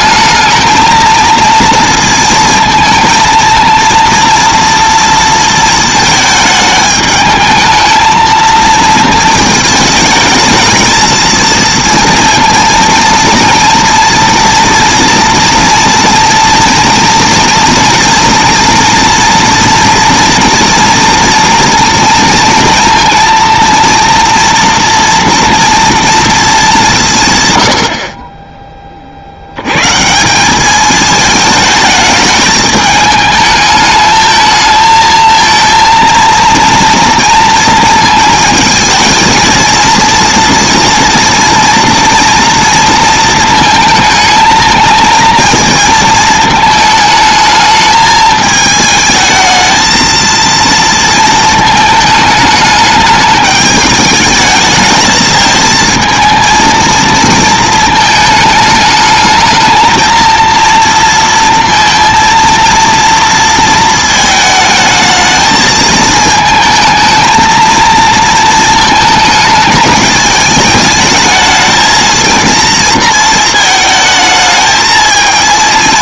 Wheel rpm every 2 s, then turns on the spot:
220, 230, 230, 210, 230, 220, 230, 230, 230, 230, 230, 230, 230, 180, 20, 200, 210, 220, 230, 230, 230, 230, 220, 220, 220, 230, 210, 220, 230, 220, 230, 230, 220, 220, 230, 210, 230, 220.
none